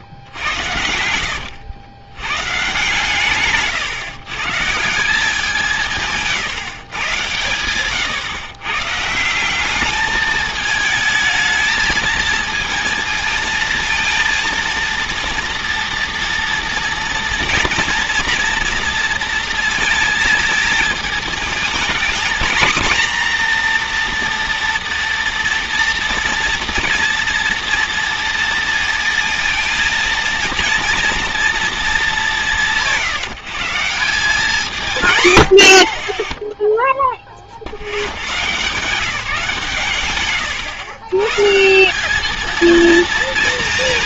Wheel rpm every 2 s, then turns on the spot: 70, 140, 150, 150, 130, 220, 230, 230, 240, 230, 220, 240, 240, 230, 230, 230, 170, 180, 0, 140, 120, 230.
none